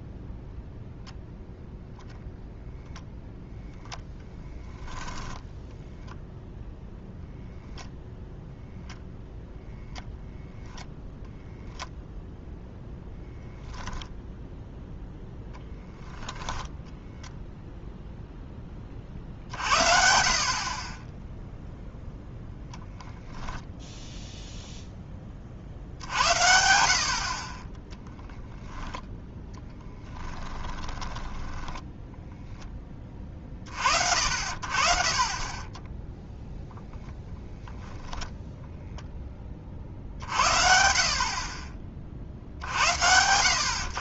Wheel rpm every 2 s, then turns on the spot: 0, 0, 10, 0, 0, 0, 10, 0, 10, 20, 30, 0, 0, 70, 10, 20, 10, 50, 0, 0, 60, 70.
4-6 16-18 28-32